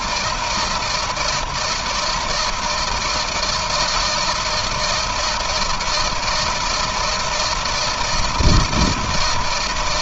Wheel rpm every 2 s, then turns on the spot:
160, 160, 160, 160, 160.
none